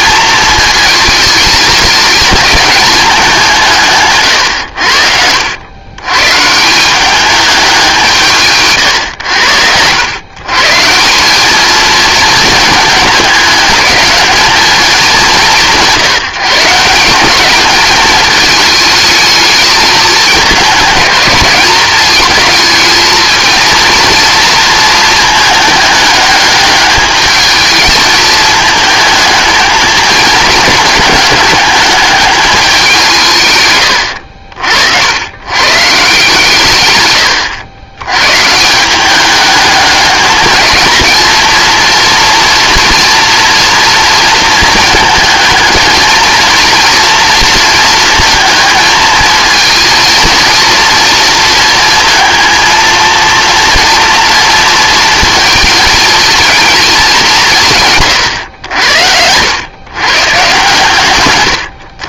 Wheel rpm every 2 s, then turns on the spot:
220, 210, 90, 180, 130, 160, 220, 210, 170, 210, 200, 220, 220, 210, 220, 210, 190, 70, 120, 170, 220, 230, 220, 230, 230, 230, 230, 230, 210, 90, 140.
none